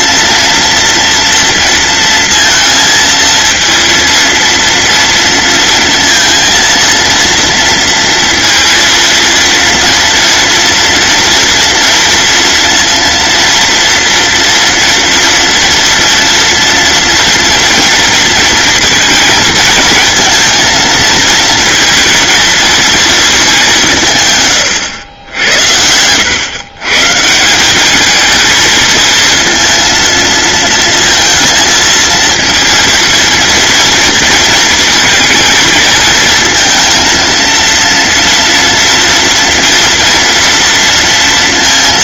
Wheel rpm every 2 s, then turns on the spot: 230, 230, 230, 230, 230, 230, 230, 230, 230, 230, 230, 230, 100, 130, 220, 230, 230, 230, 230, 230, 230.
none